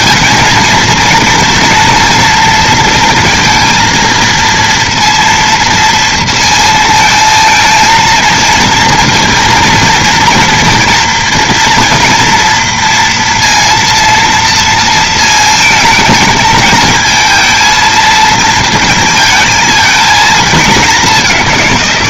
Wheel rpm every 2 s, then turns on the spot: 230, 230, 230, 230, 230, 230, 230, 230, 220, 230, 220.
none